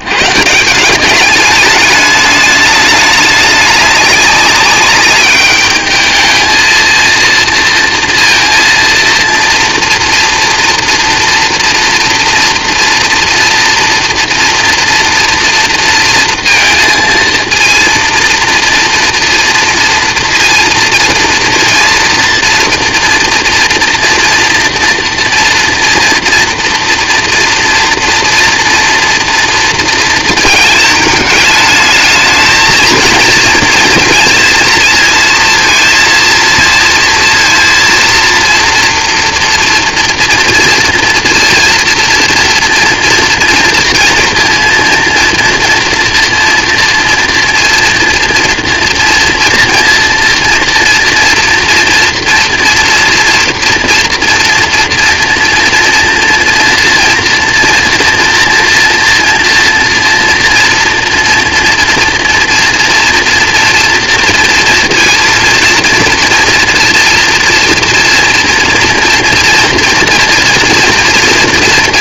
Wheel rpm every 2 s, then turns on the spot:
160, 210, 200, 230, 230, 230, 230, 230, 230, 230, 230, 230, 230, 230, 230, 220, 220, 220, 230, 230, 230, 230, 230, 230, 230, 230, 230, 230, 230, 240, 240, 230, 230, 230, 230, 240.
none